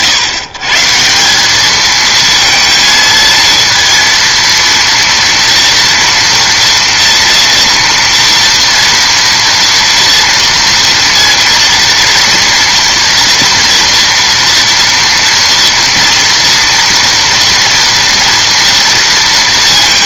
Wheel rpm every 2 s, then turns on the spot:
140, 220, 230, 230, 230, 230, 230, 230, 230, 230.
none